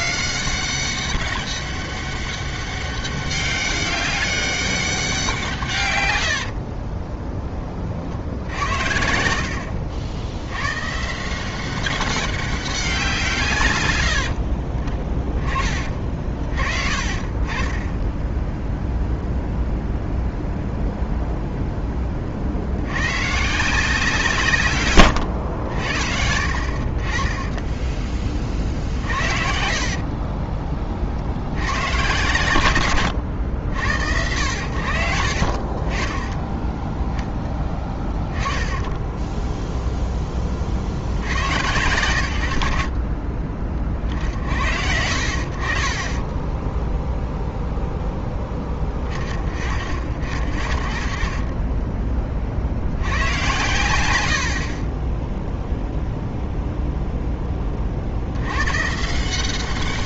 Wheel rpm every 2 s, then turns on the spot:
200, 200, 180, 20, 70, 140, 180, 30, 40, 0, 0, 100, 120, 40, 50, 20, 100, 80, 20, 10, 40, 50, 60, 10, 10, 40, 60, 50, 0, 120.
6-10 24-26 36-38 46-48